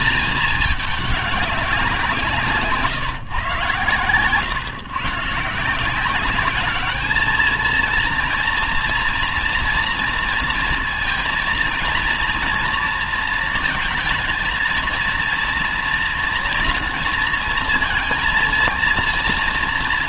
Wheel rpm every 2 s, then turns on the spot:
210, 170, 120, 210, 230, 230, 230, 220, 230, 230.
none